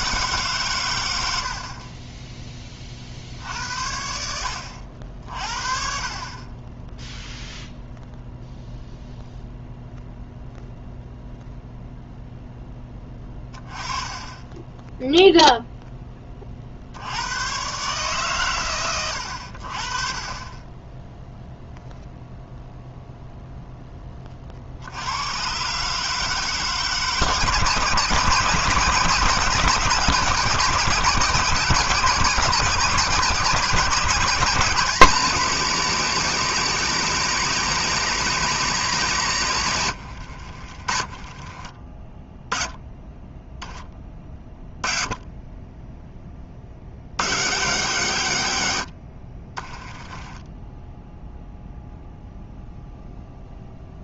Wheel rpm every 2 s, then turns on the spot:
120, 40, 70, 20, 0, 0, 10, 0, 60, 110, 10, 0, 70, 160, 160, 170, 150, 170, 190, 190, 40, 10, 20, 80, 80, 10, 0.
40-42 50-52